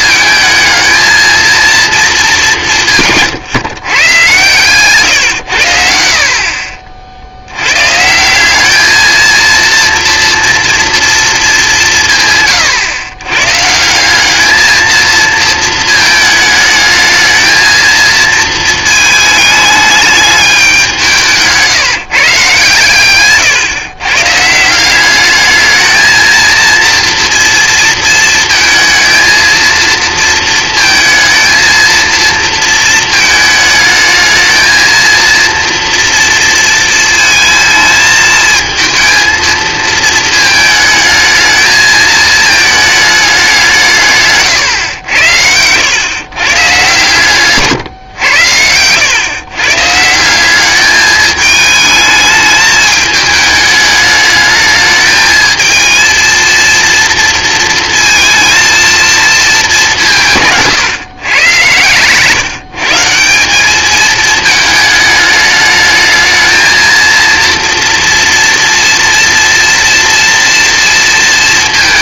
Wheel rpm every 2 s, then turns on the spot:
220, 170, 120, 50, 200, 230, 140, 220, 220, 220, 200, 140, 170, 230, 230, 230, 230, 220, 230, 220, 220, 220, 120, 120, 100, 190, 210, 220, 230, 230, 170, 150, 220, 220, 230, 230.
none